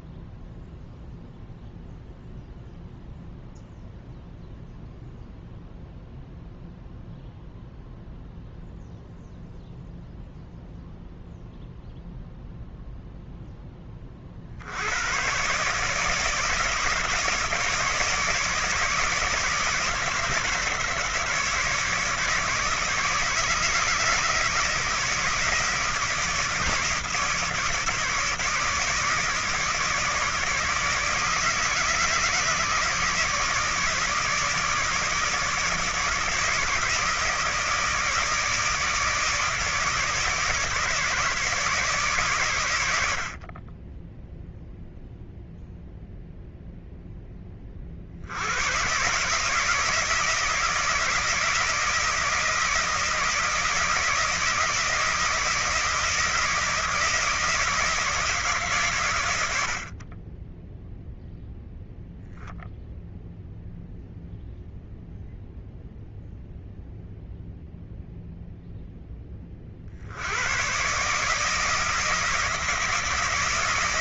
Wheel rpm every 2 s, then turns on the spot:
0, 0, 0, 0, 0, 0, 0, 80, 160, 160, 160, 150, 160, 160, 150, 150, 150, 160, 150, 160, 160, 100, 0, 0, 120, 160, 160, 160, 160, 140, 0, 0, 0, 0, 0, 120, 160.
none